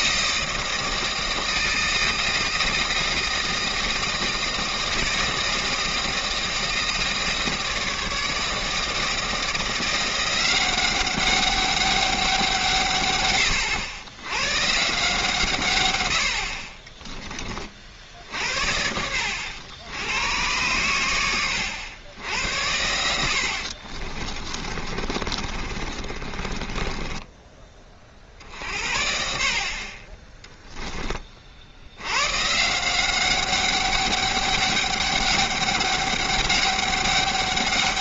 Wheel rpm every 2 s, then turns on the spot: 160, 160, 160, 160, 160, 190, 160, 130, 50, 70, 110, 90, 30, 30, 50, 10, 160, 200, 200.
24-28